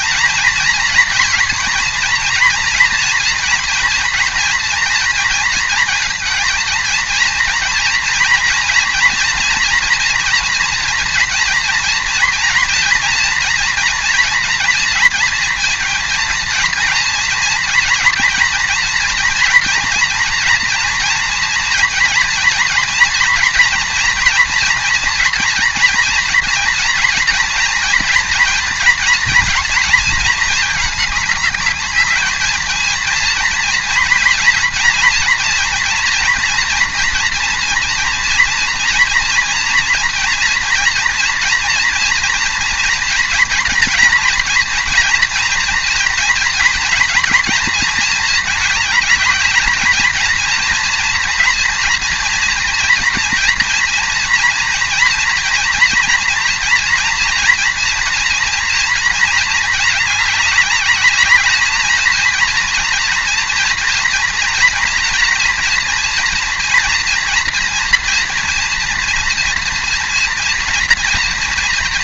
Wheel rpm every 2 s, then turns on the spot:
230, 240, 230, 230, 230, 230, 240, 230, 230, 240, 240, 230, 230, 230, 230, 220, 220, 230, 230, 230, 230, 230, 230, 240, 220, 230, 230, 230, 230, 230, 200, 230, 240, 240, 230, 230.
none